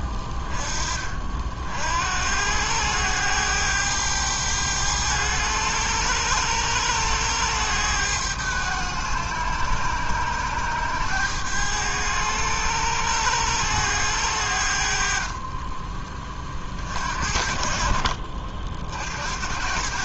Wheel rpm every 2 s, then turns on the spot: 20, 90, 100, 100, 100, 100, 100, 80, 40, 60.
none